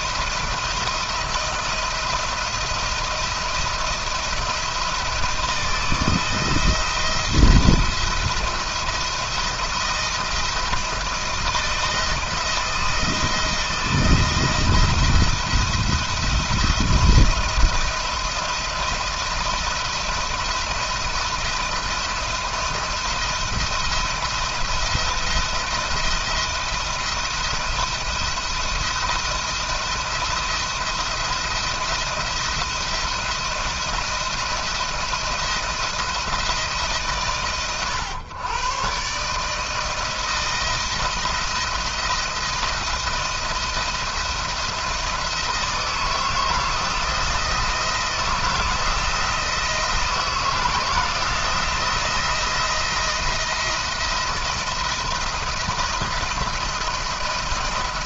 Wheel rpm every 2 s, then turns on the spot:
170, 170, 170, 170, 170, 170, 160, 160, 160, 170, 170, 170, 170, 170, 170, 170, 170, 170, 150, 130, 170, 170, 160, 160, 160, 160, 170, 170, 170.
none